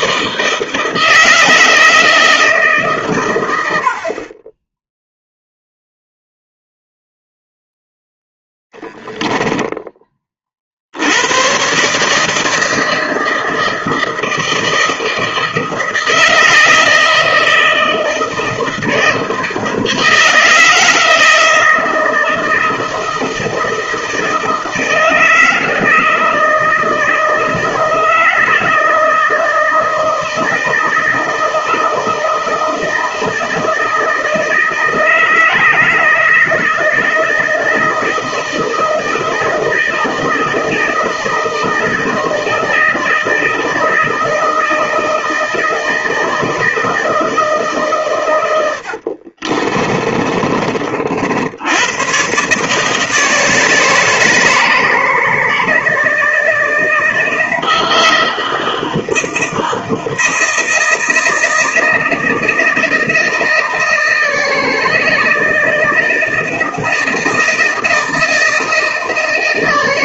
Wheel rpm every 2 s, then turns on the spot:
170, 140, 10, 0, 10, 70, 160, 160, 160, 160, 160, 160, 160, 160, 160, 160, 160, 160, 160, 160, 160, 160, 160, 160, 80, 50, 150, 160, 160, 160, 160, 160, 160, 160, 160.
8-10 48-50